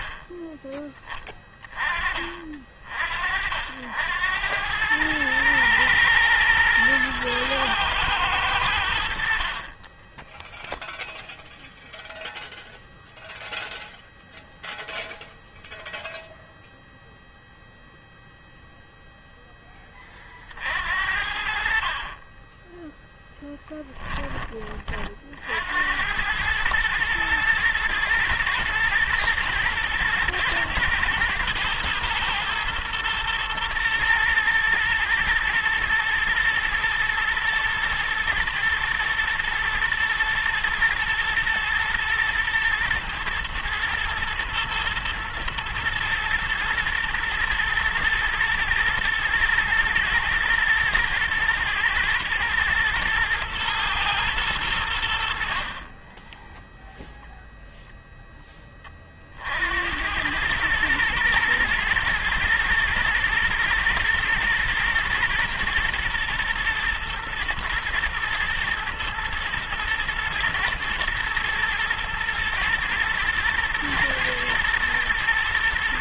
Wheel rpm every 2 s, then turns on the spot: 20, 50, 100, 110, 100, 0, 0, 0, 0, 0, 50, 10, 30, 110, 120, 110, 120, 120, 120, 110, 120, 110, 110, 120, 120, 110, 120, 90, 0, 30, 110, 120, 120, 120, 110, 120, 120, 110.
8-10 20-24